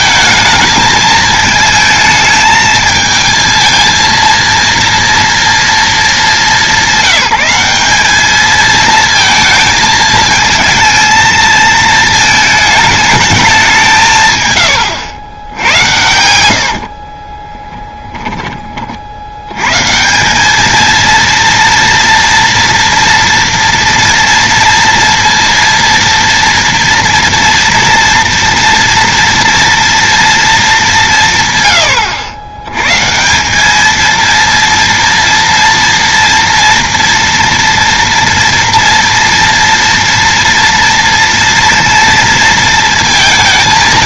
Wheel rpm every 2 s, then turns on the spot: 220, 220, 230, 190, 220, 220, 220, 120, 80, 20, 210, 230, 230, 230, 240, 220, 110, 230, 230, 230, 230, 230.
none